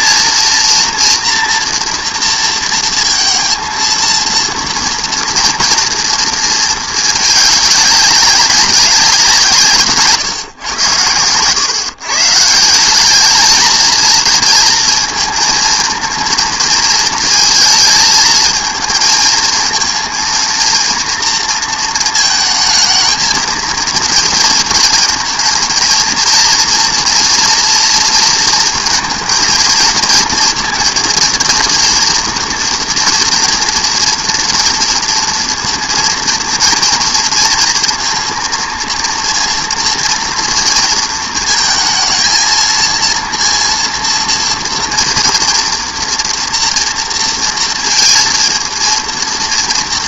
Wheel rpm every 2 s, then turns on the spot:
230, 230, 230, 220, 200, 120, 160, 230, 230, 230, 230, 220, 230, 240, 230, 230, 230, 230, 240, 230, 230, 230, 230, 230, 230.
none